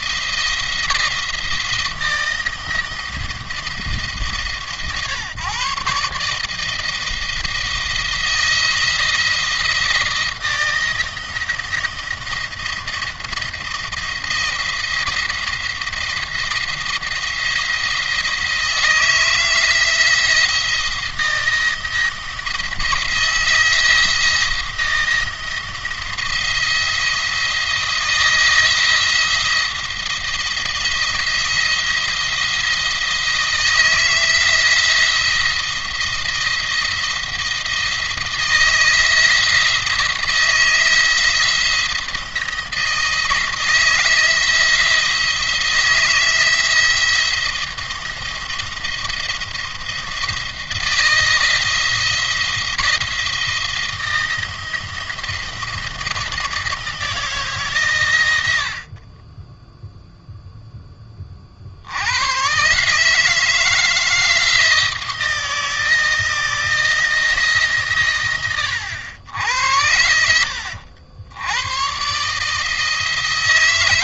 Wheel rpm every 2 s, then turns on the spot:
160, 160, 150, 160, 170, 160, 170, 170, 170, 160, 170, 160, 160, 170, 170, 170, 170, 160, 170, 160, 170, 170, 170, 170, 170, 160, 170, 170, 160, 60, 10, 150, 160, 170, 90, 70, 160.
none